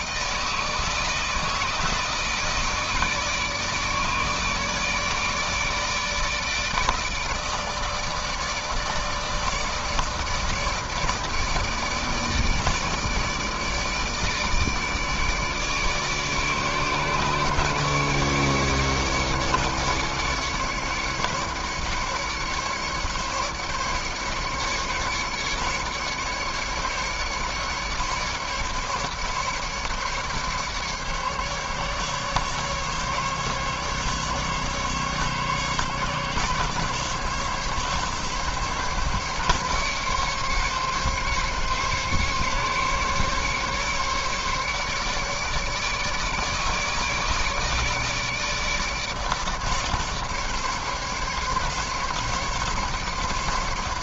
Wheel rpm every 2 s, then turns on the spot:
160, 160, 150, 160, 150, 160, 150, 150, 150, 150, 140, 140, 140, 150, 150, 150, 140, 140, 140, 140, 140, 140, 140, 150, 150, 150, 150.
none